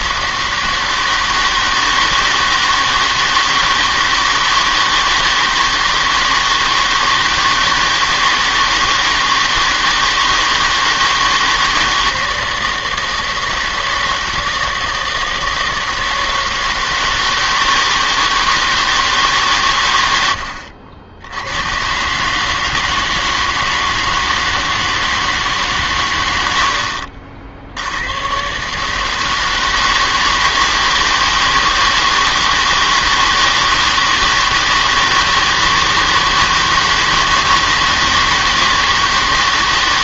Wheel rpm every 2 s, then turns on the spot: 160, 160, 160, 160, 160, 160, 160, 160, 160, 160, 70, 150, 160, 70, 130, 160, 160, 160, 160, 160.
20-22